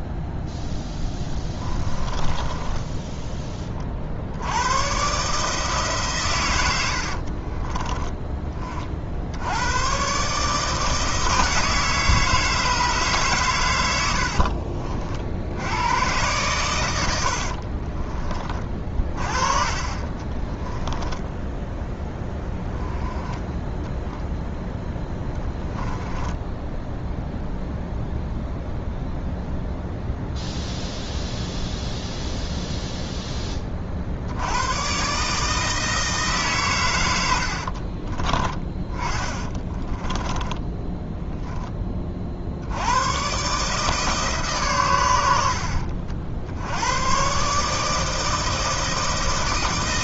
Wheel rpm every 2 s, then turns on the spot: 0, 20, 90, 100, 30, 150, 150, 50, 110, 30, 20, 10, 0, 10, 0, 0, 0, 90, 140, 20, 10, 60, 140, 80, 160.
2-4 14-16 20-22 38-42